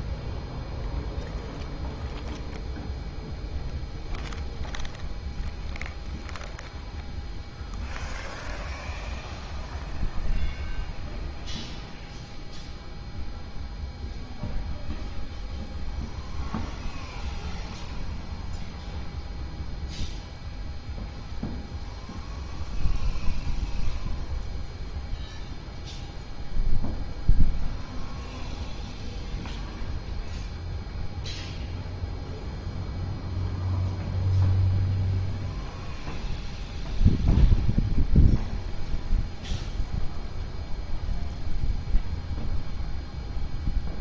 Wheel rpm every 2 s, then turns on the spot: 0, 0, 0, 0, 0, 0, 0, 0, 0, 0, 0, 0, 0, 0, 0, 0, 0, 0, 0, 0, 0, 0.
none